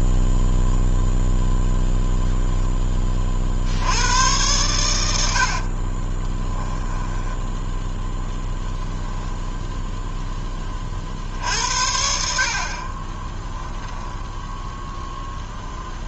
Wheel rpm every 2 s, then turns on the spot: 0, 0, 110, 10, 0, 10, 50, 0.
6-8